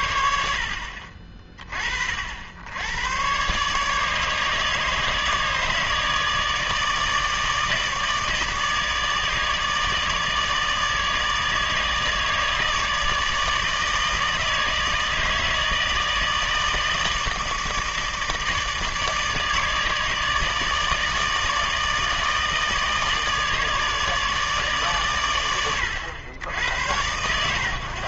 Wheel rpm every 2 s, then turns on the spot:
70, 80, 150, 160, 160, 150, 160, 160, 160, 160, 150, 160, 140, 90.
none